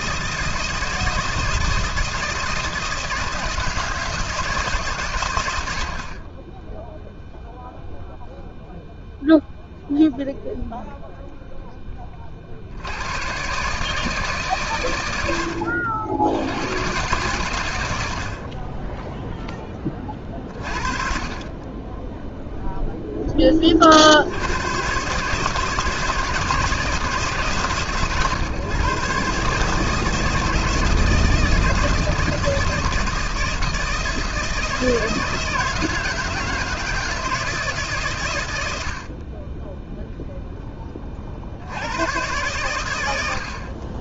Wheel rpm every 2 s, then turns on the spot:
160, 160, 150, 0, 0, 0, 60, 130, 90, 40, 30, 0, 90, 160, 120, 160, 160, 160, 160, 110, 0, 120.
none